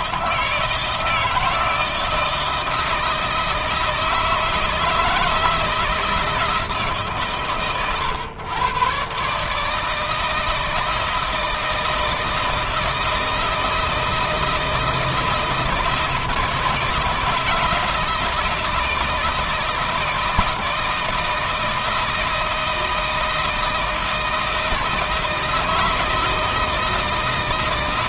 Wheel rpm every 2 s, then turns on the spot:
160, 160, 160, 140, 120, 160, 160, 160, 160, 160, 160, 160, 160, 160.
none